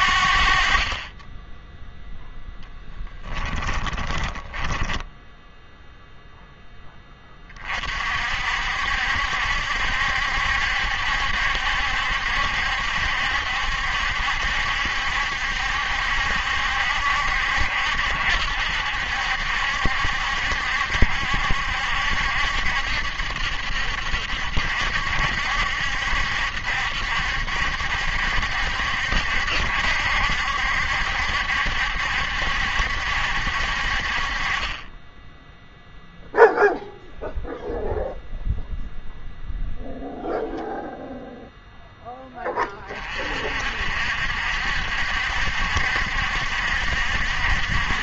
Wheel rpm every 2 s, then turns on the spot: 40, 10, 10, 10, 60, 70, 70, 70, 70, 70, 70, 70, 70, 70, 70, 70, 70, 30, 0, 0, 0, 30, 60, 70.
2-6